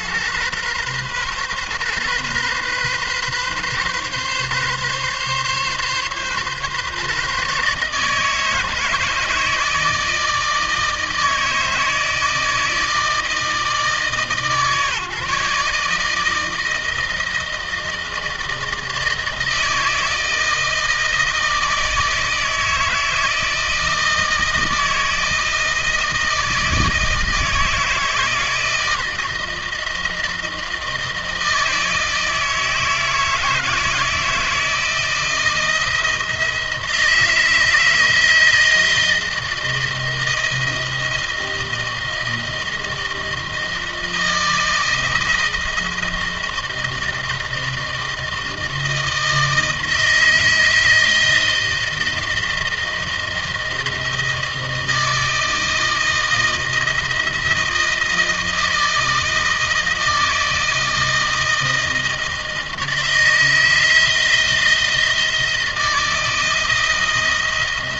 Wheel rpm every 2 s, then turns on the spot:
120, 130, 140, 140, 150, 160, 160, 150, 160, 160, 170, 160, 160, 160, 160, 160, 160, 160, 160, 160, 160, 160, 160, 160, 160, 160, 170, 160, 160, 160, 160, 160, 170, 160.
none